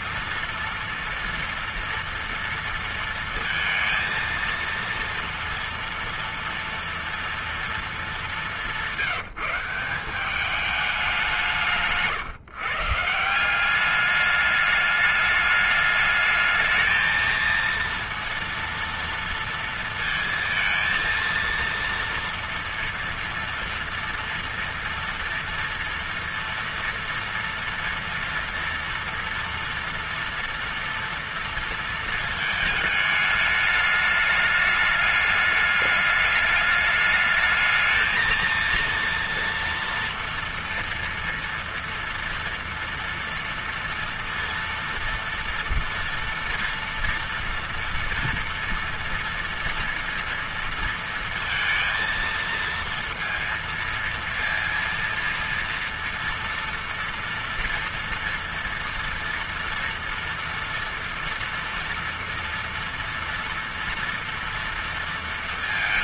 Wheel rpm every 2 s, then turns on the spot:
230, 230, 230, 230, 190, 200, 150, 210, 210, 230, 230, 230, 240, 230, 230, 240, 220, 210, 210, 230, 230, 230, 230, 230, 240, 230, 230, 230, 230, 230, 230, 230, 230.
none